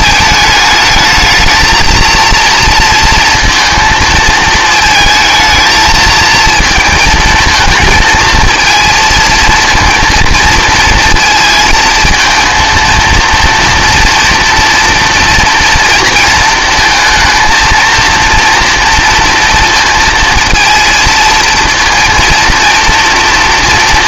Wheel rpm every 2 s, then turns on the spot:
220, 230, 220, 220, 230, 230, 230, 230, 230, 230, 230, 230.
none